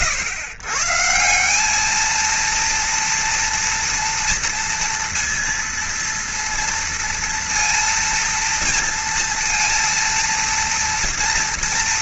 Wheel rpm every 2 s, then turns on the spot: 130, 240, 230, 230, 230, 230.
none